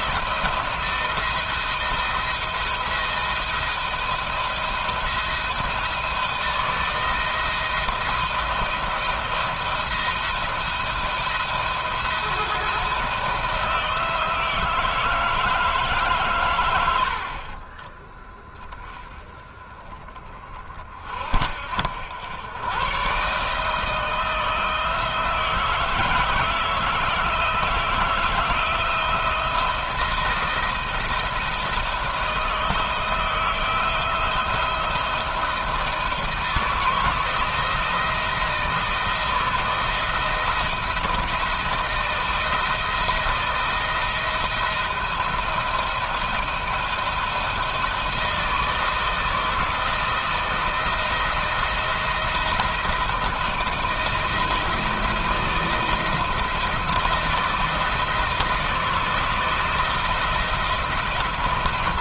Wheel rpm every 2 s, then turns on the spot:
160, 170, 170, 160, 170, 170, 170, 160, 110, 20, 50, 110, 160, 160, 160, 170, 160, 170, 160, 170, 170, 170, 160, 170, 160, 170, 170, 160, 170, 160, 170.
none